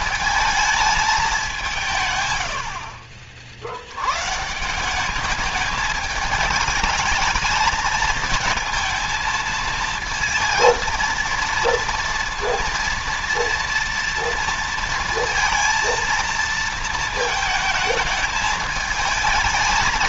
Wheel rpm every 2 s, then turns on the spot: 210, 60, 180, 220, 230, 230, 230, 230, 220, 220.
none